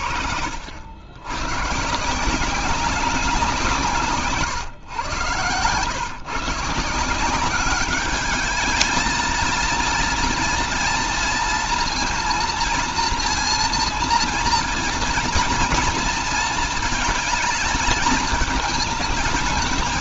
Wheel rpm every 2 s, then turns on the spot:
90, 190, 120, 150, 220, 240, 230, 230, 220, 220.
none